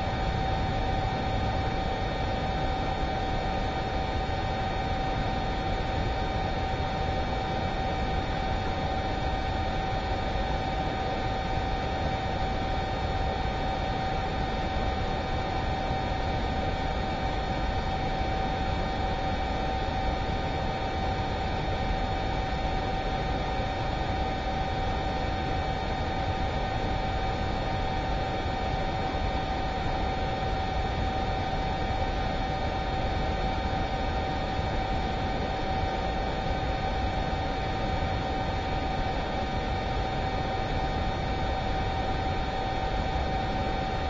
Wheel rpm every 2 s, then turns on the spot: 0, 0, 0, 0, 0, 0, 0, 0, 0, 0, 0, 0, 0, 0, 0, 0, 0, 0, 0, 0, 0, 0.
none